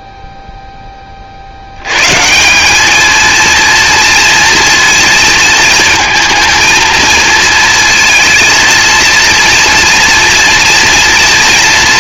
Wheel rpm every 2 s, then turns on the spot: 10, 190, 230, 230, 230, 240.
none